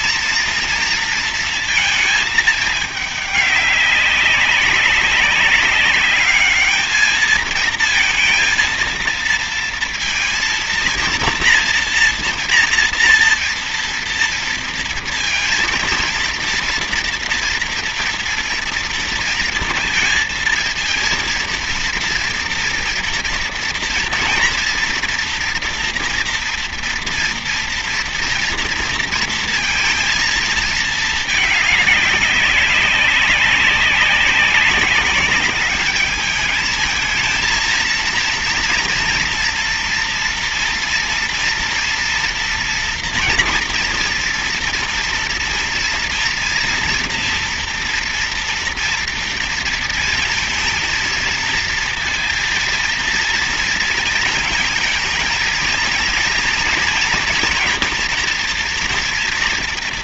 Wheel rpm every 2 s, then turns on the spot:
230, 220, 190, 210, 230, 230, 230, 230, 230, 230, 230, 230, 230, 230, 230, 230, 200, 190, 210, 230, 230, 230, 230, 230, 230, 230, 230, 220, 230, 230.
none